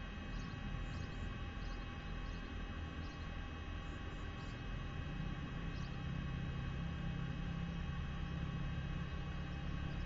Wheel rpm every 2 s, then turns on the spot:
0, 0, 0, 0, 0.
none